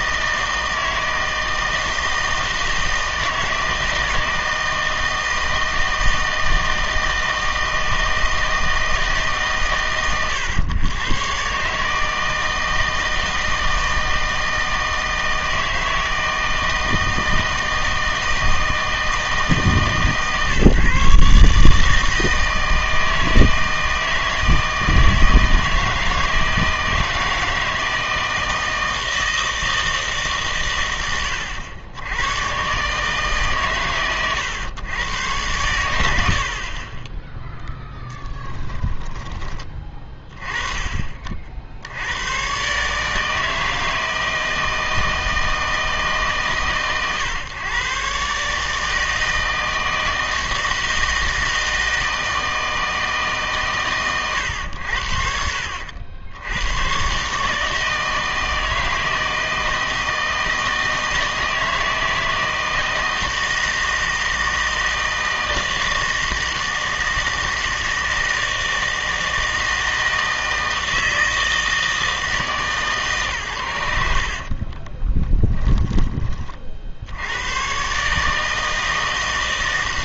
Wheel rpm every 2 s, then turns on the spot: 160, 160, 160, 160, 160, 120, 160, 160, 160, 160, 140, 160, 160, 160, 160, 120, 130, 110, 60, 10, 30, 130, 160, 140, 150, 160, 160, 90, 100, 160, 160, 160, 160, 160, 160, 160, 150, 40, 40, 160.
38-40 74-76